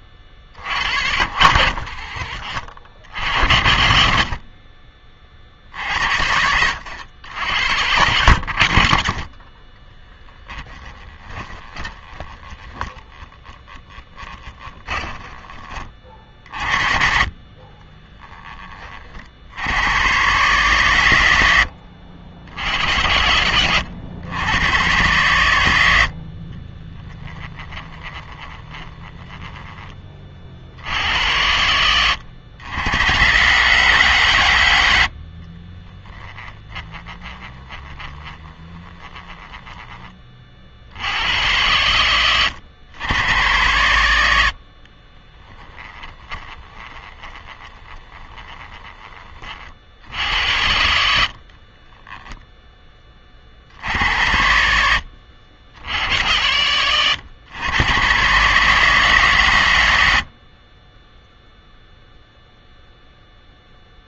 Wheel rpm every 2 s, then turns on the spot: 60, 60, 40, 90, 60, 10, 10, 20, 40, 30, 120, 90, 110, 20, 20, 70, 100, 90, 20, 20, 60, 100, 50, 20, 20, 80, 10, 80, 100, 140, 30, 0.
10-16 26-30 36-40 44-48